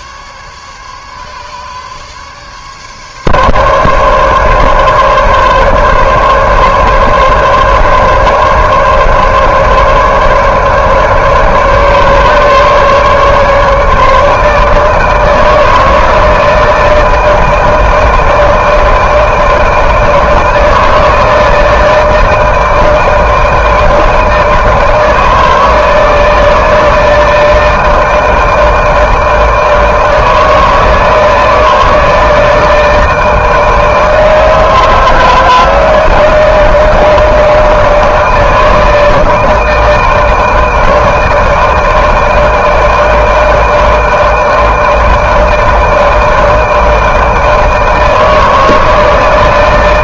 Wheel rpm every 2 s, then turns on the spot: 140, 140, 140, 140, 140, 140, 150, 150, 160, 160, 160, 160, 160, 160, 160, 160, 160, 160, 160, 160, 160, 160, 160, 160, 160.
none